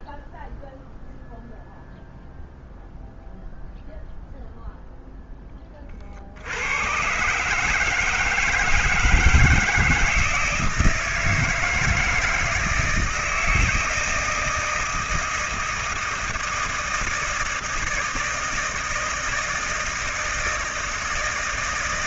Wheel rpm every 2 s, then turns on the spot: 0, 0, 0, 110, 160, 160, 160, 160, 160, 160, 160.
none